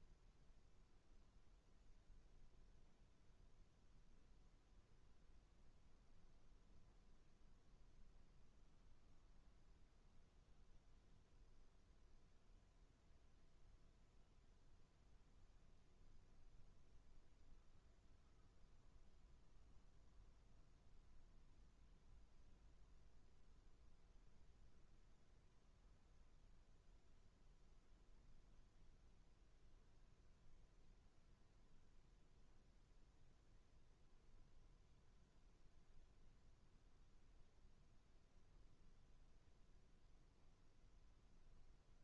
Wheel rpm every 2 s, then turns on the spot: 0, 0, 0, 0, 0, 0, 0, 0, 0, 0, 0, 0, 0, 0, 0, 0, 0, 0, 0, 0, 0.
none